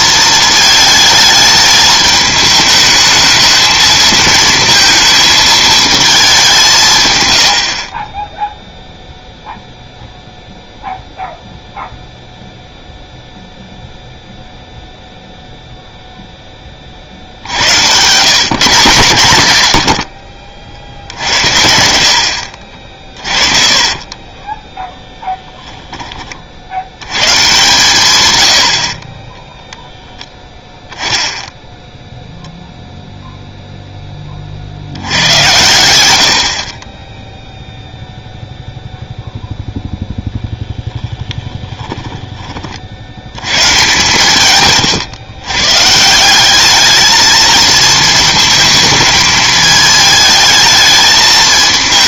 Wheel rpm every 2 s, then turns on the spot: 220, 210, 220, 170, 0, 0, 0, 0, 20, 150, 60, 60, 10, 70, 80, 0, 0, 60, 40, 0, 0, 40, 130, 210, 220, 220.
22-26